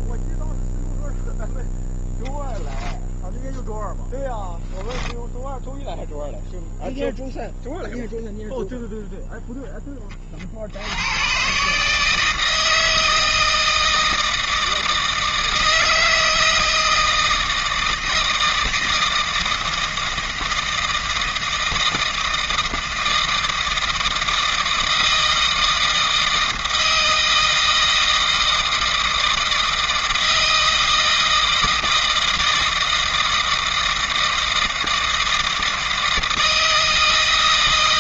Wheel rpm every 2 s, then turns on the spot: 0, 0, 0, 0, 0, 70, 160, 160, 160, 160, 160, 160, 160, 160, 160, 160, 160, 160, 160.
none